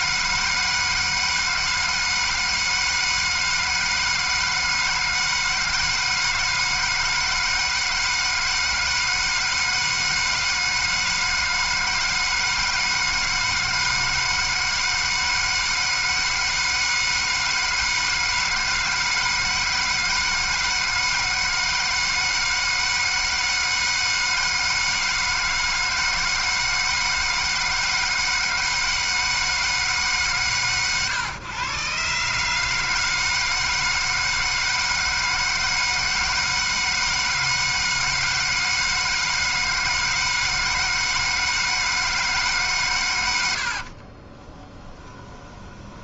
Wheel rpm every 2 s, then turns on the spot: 160, 160, 160, 160, 160, 160, 160, 160, 160, 160, 160, 160, 160, 160, 160, 120, 150, 160, 160, 160, 160, 150, 20.
44-46